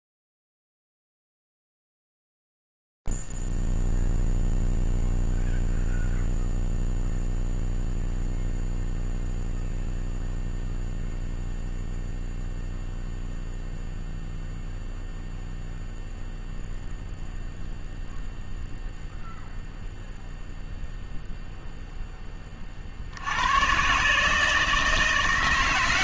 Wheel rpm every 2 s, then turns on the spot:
0, 0, 0, 0, 0, 0, 0, 0, 0, 0, 0, 30, 160.
none